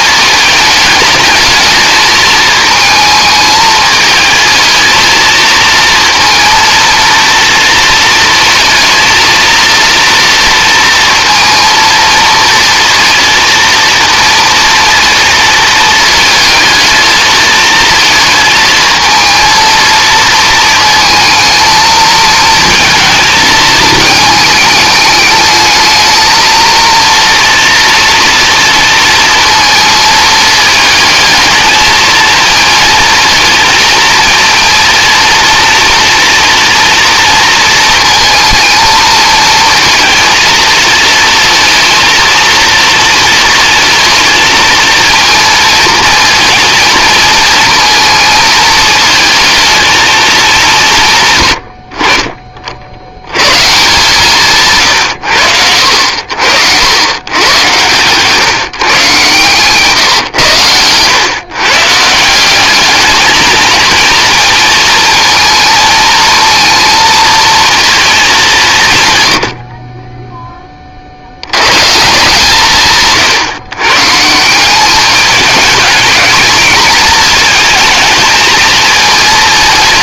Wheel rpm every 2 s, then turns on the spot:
220, 220, 220, 230, 230, 230, 230, 230, 220, 220, 220, 220, 210, 230, 230, 220, 220, 230, 240, 220, 220, 230, 220, 230, 230, 170, 50, 150, 70, 150, 120, 200, 230, 220, 170, 20, 160, 190, 230, 220.
none